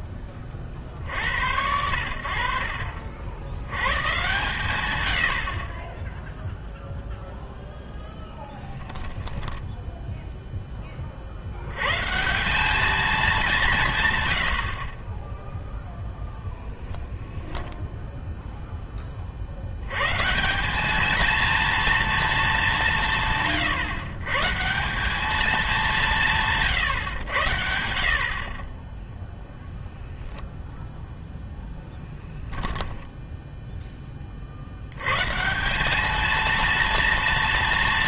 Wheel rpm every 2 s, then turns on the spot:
50, 60, 120, 0, 10, 10, 200, 60, 0, 10, 180, 190, 160, 160, 30, 0, 0, 80, 230.
8-10